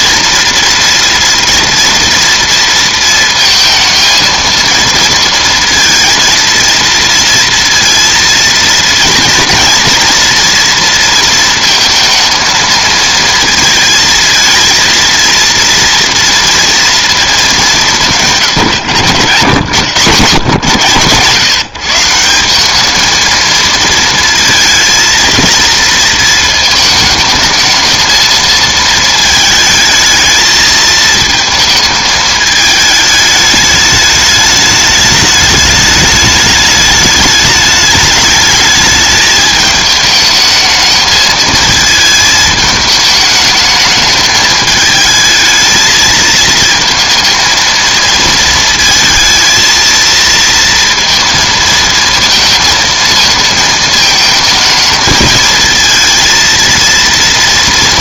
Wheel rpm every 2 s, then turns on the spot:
240, 230, 220, 230, 230, 230, 230, 230, 230, 140, 120, 190, 230, 220, 220, 220, 220, 210, 210, 220, 220, 220, 220, 220, 230, 230, 230, 220, 230.
none